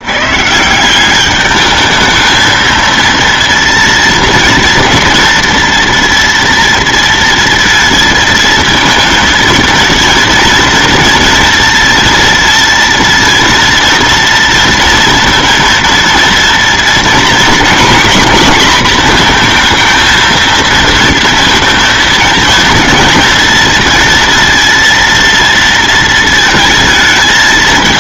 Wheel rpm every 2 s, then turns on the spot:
150, 220, 230, 230, 220, 230, 230, 230, 230, 240, 230, 230, 230, 220.
none